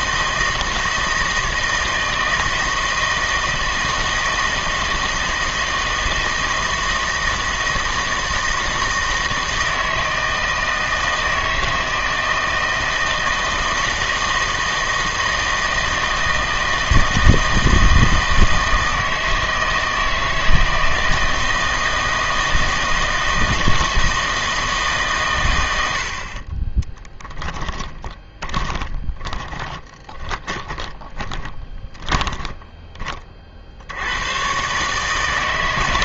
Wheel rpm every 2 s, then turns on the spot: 160, 160, 160, 160, 160, 160, 160, 160, 160, 160, 160, 160, 150, 20, 20, 20, 20, 140.
26-32